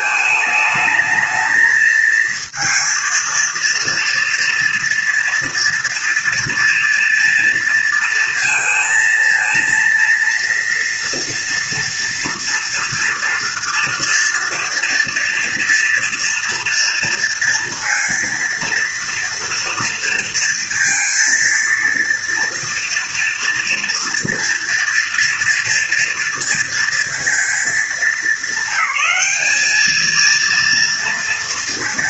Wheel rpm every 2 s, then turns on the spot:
220, 230, 230, 230, 230, 230, 230, 230, 230, 230, 230, 230, 230, 230, 200, 230.
none